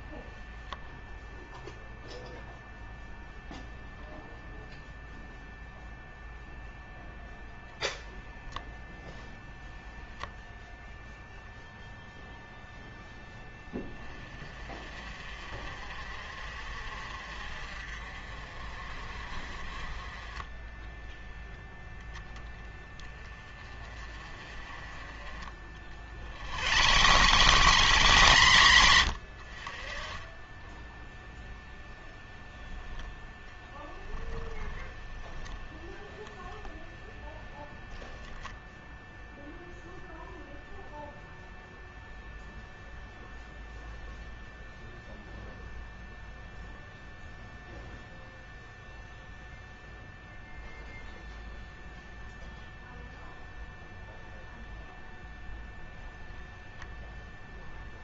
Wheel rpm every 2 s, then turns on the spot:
0, 0, 0, 0, 0, 0, 0, 40, 50, 40, 10, 20, 30, 110, 130, 10, 20, 10, 10, 0, 0, 0, 0, 0, 0, 0, 0, 0, 0.
26-28 32-36